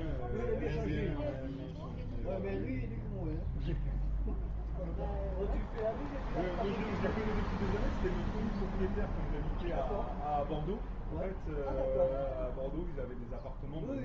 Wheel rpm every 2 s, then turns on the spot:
0, 0, 0, 0, 0, 0, 0.
none